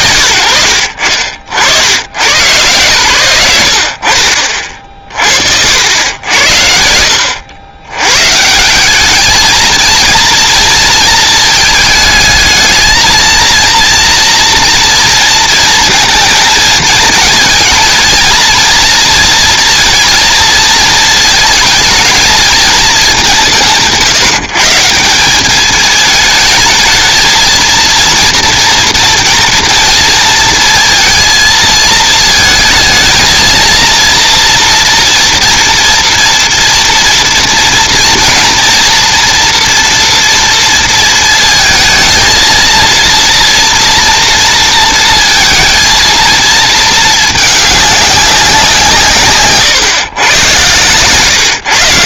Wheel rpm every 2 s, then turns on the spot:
90, 100, 50, 80, 210, 220, 230, 230, 220, 230, 220, 150, 180, 220, 230, 230, 220, 230, 230, 230, 230, 230, 230, 220, 150, 130.
none